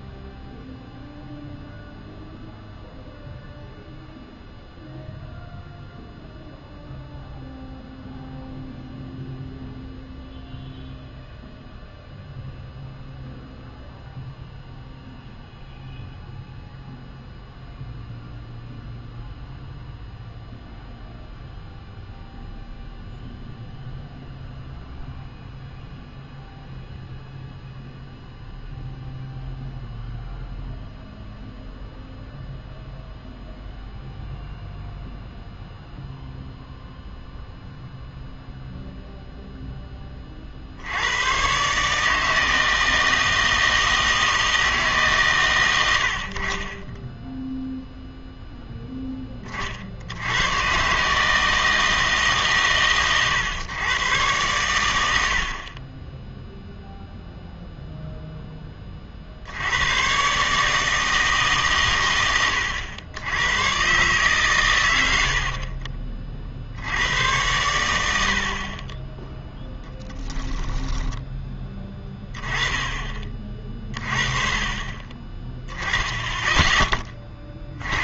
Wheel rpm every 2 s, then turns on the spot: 0, 0, 0, 0, 0, 0, 0, 0, 0, 0, 0, 0, 0, 0, 0, 0, 0, 0, 0, 0, 50, 160, 160, 30, 0, 110, 130, 100, 0, 10, 150, 100, 110, 60, 50, 10, 20, 30, 10.
70-72